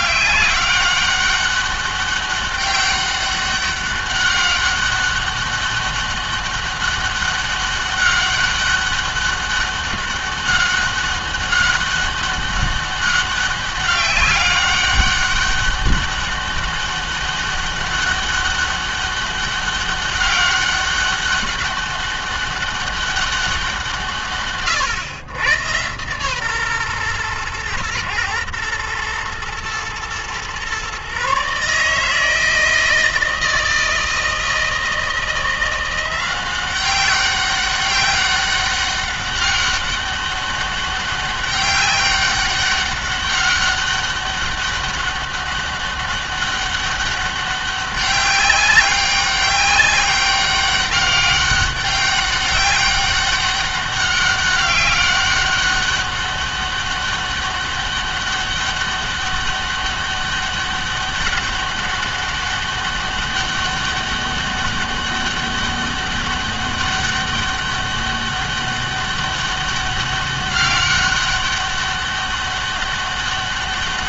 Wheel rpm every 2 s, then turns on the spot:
200, 200, 200, 200, 200, 200, 200, 200, 200, 200, 200, 200, 130, 130, 110, 130, 160, 160, 190, 190, 200, 200, 200, 200, 200, 200, 200, 200, 200, 200, 200, 200, 200, 200, 200, 200, 200.
none